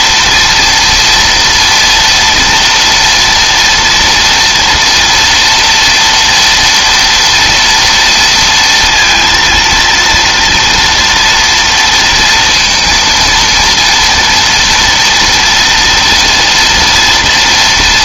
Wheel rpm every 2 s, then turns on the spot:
230, 240, 230, 230, 230, 230, 230, 230, 240.
none